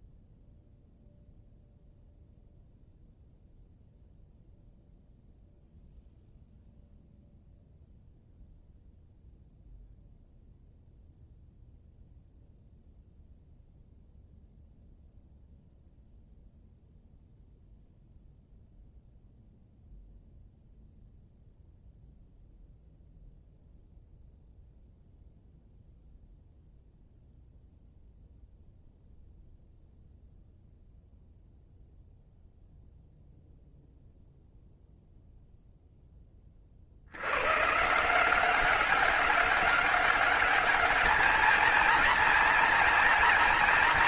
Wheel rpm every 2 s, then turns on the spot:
0, 0, 0, 0, 0, 0, 0, 0, 0, 0, 0, 0, 0, 0, 0, 0, 0, 0, 70, 190, 220, 230.
none